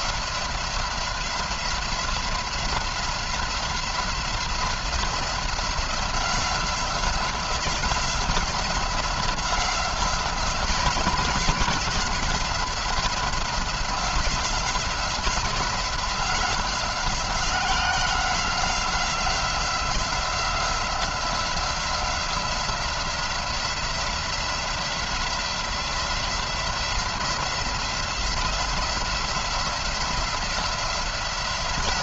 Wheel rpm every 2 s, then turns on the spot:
180, 180, 180, 180, 180, 180, 180, 180, 180, 180, 180, 180, 170, 170, 170, 170.
none